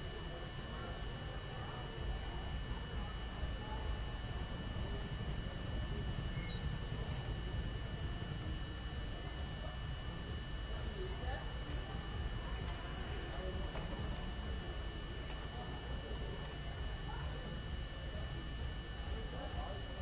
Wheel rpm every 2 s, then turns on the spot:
0, 0, 0, 0, 0, 0, 0, 0, 0, 0.
none